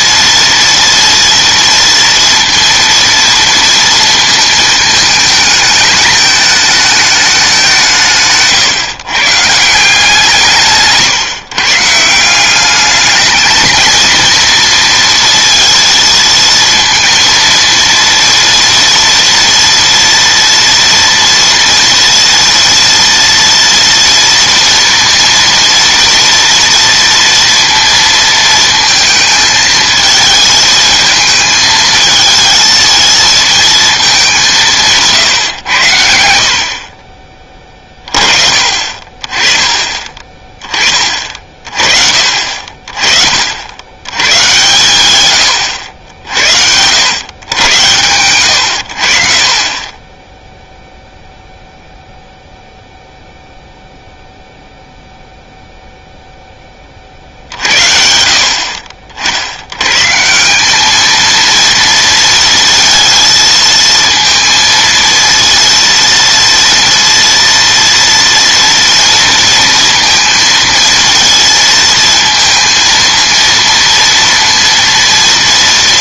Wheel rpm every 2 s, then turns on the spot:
230, 230, 220, 220, 140, 160, 200, 230, 230, 240, 230, 230, 230, 230, 220, 220, 220, 170, 50, 40, 20, 40, 130, 80, 90, 0, 0, 0, 20, 50, 200, 230, 230, 230, 240, 230, 230, 230.
none